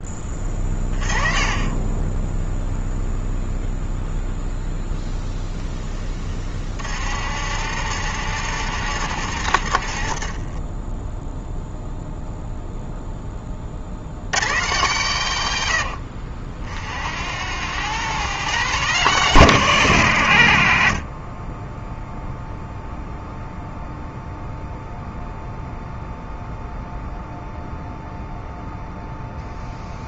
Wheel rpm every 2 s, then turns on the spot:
30, 0, 0, 60, 90, 10, 0, 140, 60, 140, 50, 0, 0, 0, 0.
6-12